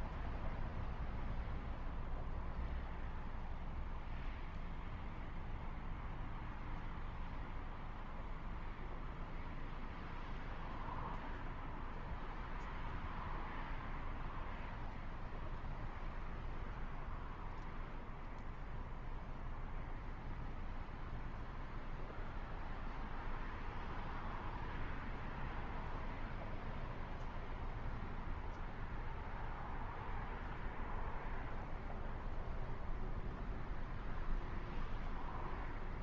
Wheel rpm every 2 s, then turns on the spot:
0, 0, 0, 0, 0, 0, 0, 0, 0, 0, 0, 0, 0, 0, 0, 0, 0, 0.
none